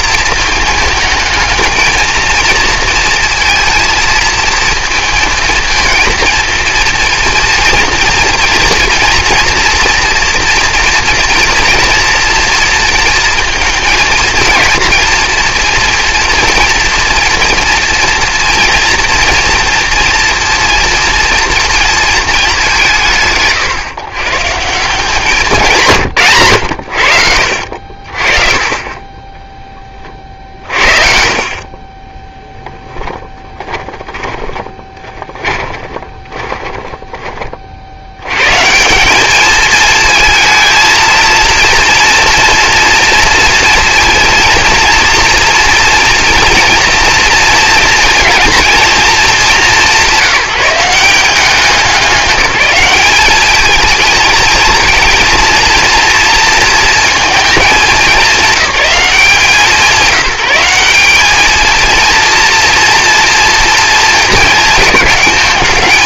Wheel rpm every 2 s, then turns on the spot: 220, 230, 230, 230, 230, 230, 230, 230, 230, 230, 230, 170, 170, 80, 20, 50, 20, 20, 20, 150, 230, 230, 230, 230, 230, 180, 200, 220, 230, 210, 190, 230, 220.
32-38